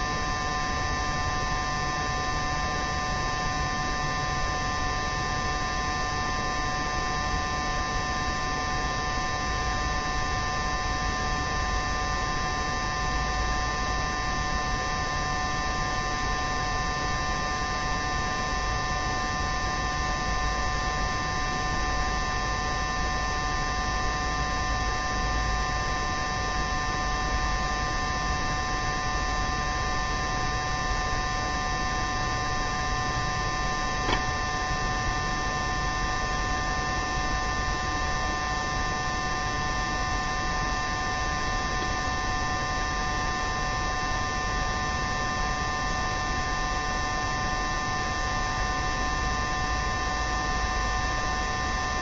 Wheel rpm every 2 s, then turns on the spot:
0, 0, 0, 0, 0, 0, 0, 0, 0, 0, 0, 0, 0, 0, 0, 0, 0, 0, 0, 0, 0, 0, 0, 0, 0, 0.
none